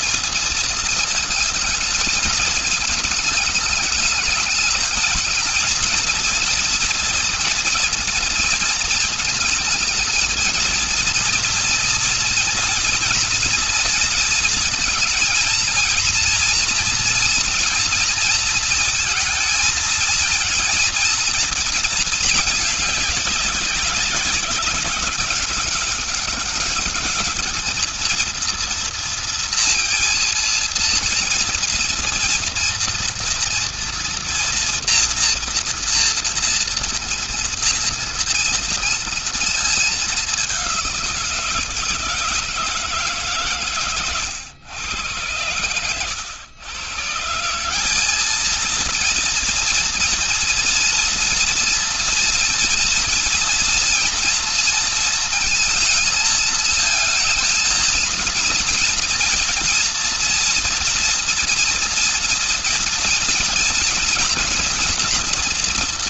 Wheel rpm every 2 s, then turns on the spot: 230, 210, 210, 230, 220, 230, 230, 230, 230, 230, 230, 210, 190, 210, 230, 230, 230, 240, 230, 230, 190, 160, 110, 130, 230, 230, 230, 230, 220, 220, 230, 230, 230.
none